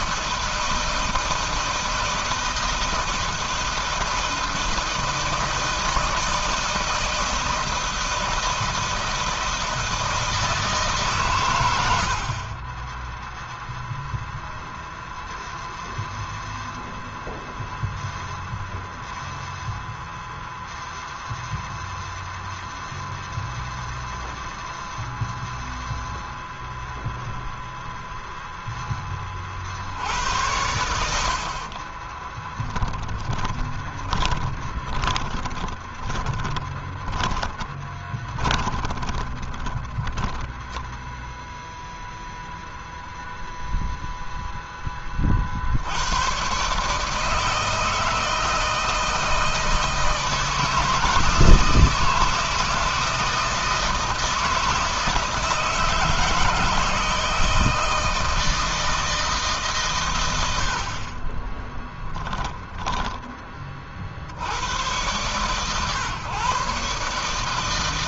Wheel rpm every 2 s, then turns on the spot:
160, 160, 170, 160, 160, 150, 30, 0, 0, 0, 0, 0, 0, 0, 0, 90, 10, 20, 20, 30, 10, 0, 10, 120, 160, 160, 170, 160, 160, 160, 90, 10, 90, 130.
32-40 62-64